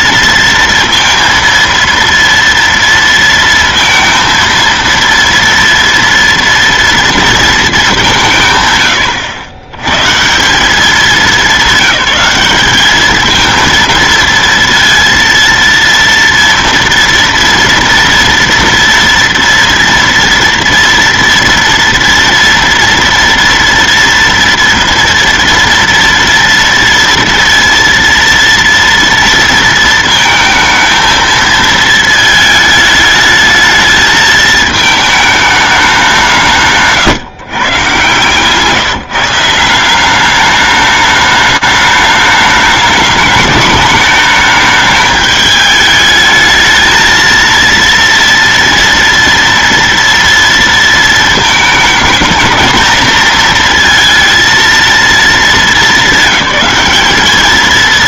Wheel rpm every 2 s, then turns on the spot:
230, 230, 230, 230, 170, 150, 200, 230, 230, 230, 230, 230, 230, 230, 230, 230, 220, 220, 180, 140, 190, 210, 210, 220, 230, 230, 220, 230, 200.
none